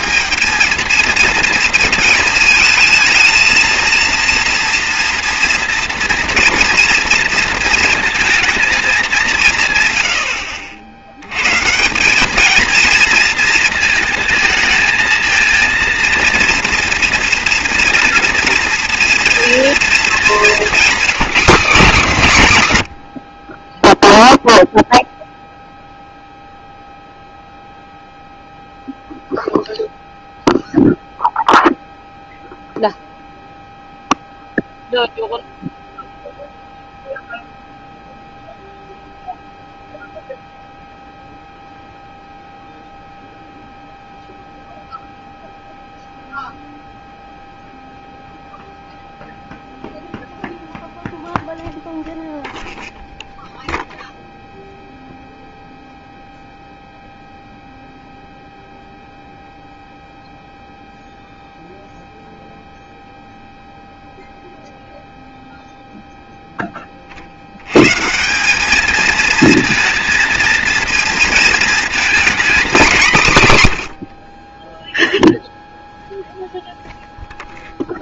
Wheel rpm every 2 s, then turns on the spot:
230, 220, 230, 240, 220, 60, 220, 220, 230, 230, 230, 150, 0, 0, 0, 0, 0, 0, 0, 0, 0, 0, 0, 0, 0, 0, 0, 0, 0, 0, 0, 0, 0, 10, 210, 230, 230, 10, 0.
none